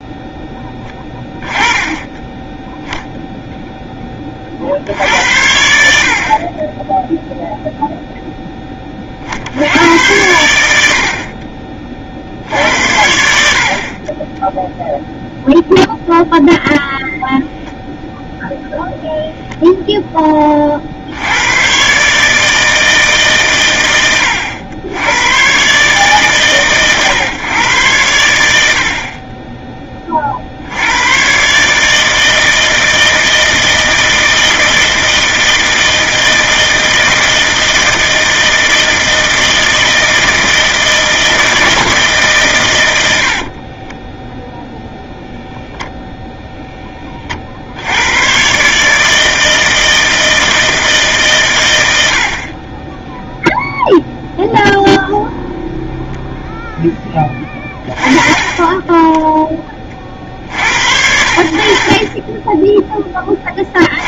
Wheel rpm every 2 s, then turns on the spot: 10, 10, 40, 40, 10, 80, 70, 0, 0, 0, 30, 160, 90, 130, 80, 60, 160, 160, 160, 160, 160, 120, 0, 20, 130, 160, 30, 0, 0, 30, 60, 10.
none